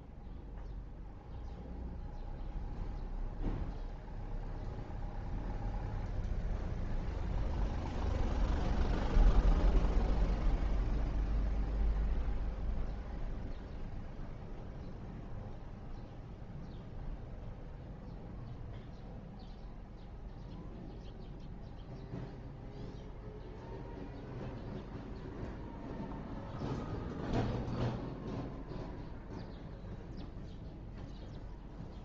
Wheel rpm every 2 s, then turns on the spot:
0, 0, 0, 0, 0, 0, 0, 0, 0, 0, 0, 0, 0, 0, 0, 0.
none